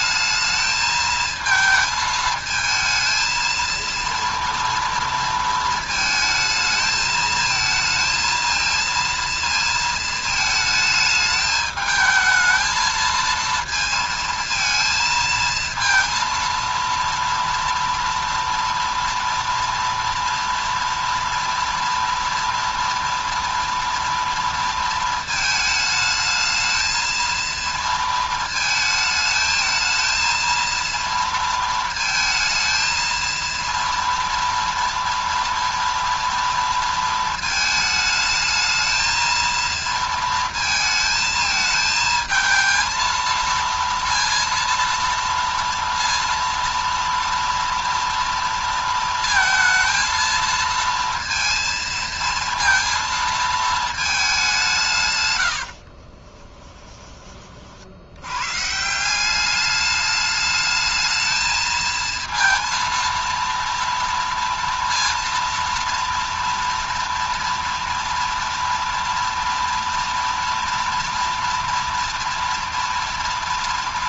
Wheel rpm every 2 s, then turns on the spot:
220, 220, 230, 220, 230, 220, 220, 220, 230, 230, 230, 230, 230, 220, 220, 230, 230, 230, 230, 220, 230, 220, 230, 230, 230, 230, 230, 180, 20, 140, 210, 230, 230, 230, 230, 230, 230.
56-58